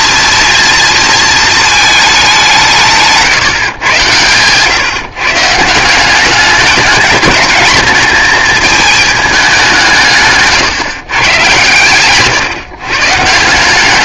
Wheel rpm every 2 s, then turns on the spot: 230, 160, 140, 210, 220, 140, 150.
none